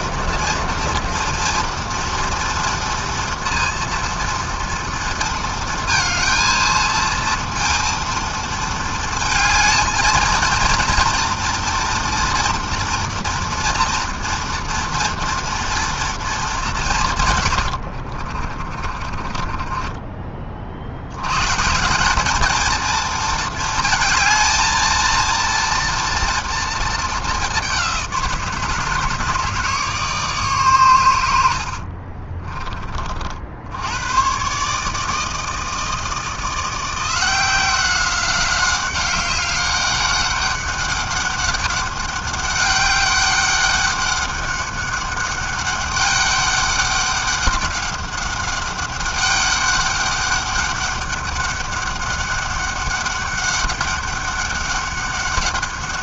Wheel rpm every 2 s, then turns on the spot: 230, 230, 230, 230, 230, 230, 230, 230, 200, 40, 40, 210, 220, 230, 160, 140, 30, 130, 170, 190, 200, 200, 200, 200, 200, 200, 200, 200.
18-20 32-34